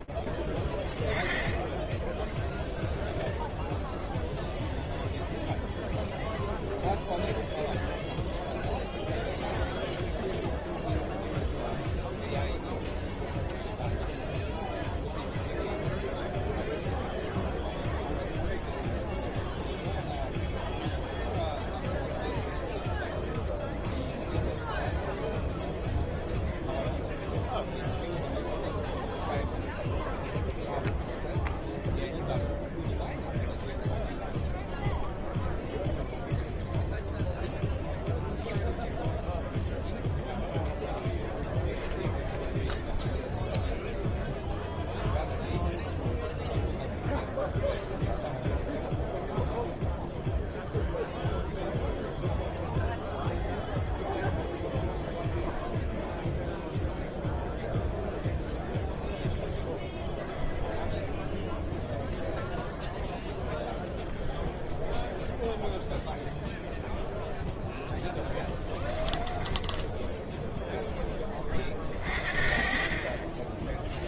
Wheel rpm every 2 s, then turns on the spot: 0, 0, 0, 0, 0, 0, 0, 0, 0, 0, 0, 0, 0, 0, 0, 0, 0, 0, 0, 0, 0, 0, 0, 0, 0, 0, 0, 0, 0, 0, 0, 0, 0, 10, 10, 20, 10.
66-70